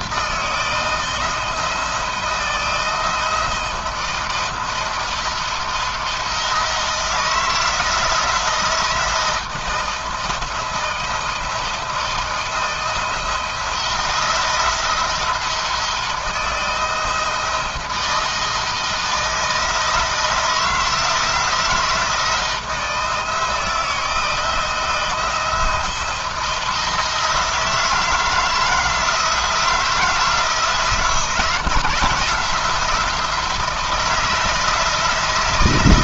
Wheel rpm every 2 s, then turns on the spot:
170, 160, 170, 170, 160, 160, 160, 170, 160, 160, 160, 160, 170, 170, 160, 160, 160, 160.
none